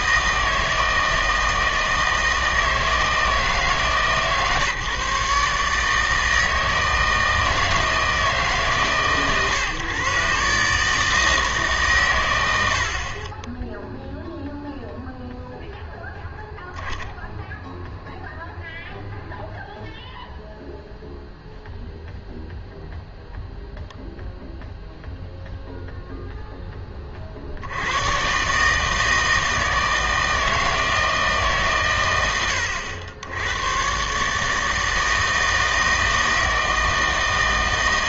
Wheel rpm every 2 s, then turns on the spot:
160, 160, 140, 160, 150, 140, 80, 0, 0, 0, 0, 0, 0, 10, 150, 160, 90, 160, 160.
none